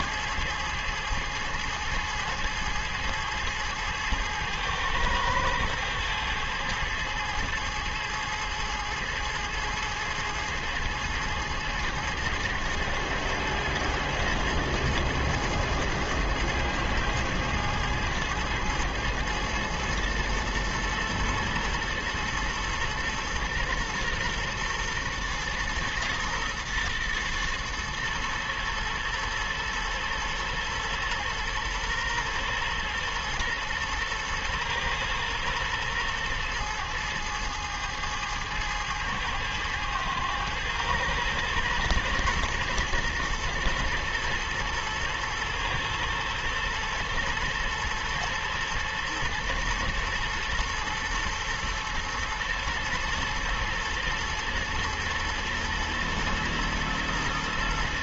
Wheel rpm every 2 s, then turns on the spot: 110, 110, 110, 110, 110, 110, 110, 110, 110, 110, 110, 110, 120, 120, 120, 120, 120, 120, 110, 110, 110, 110, 120, 120, 110, 110, 120, 110, 120.
none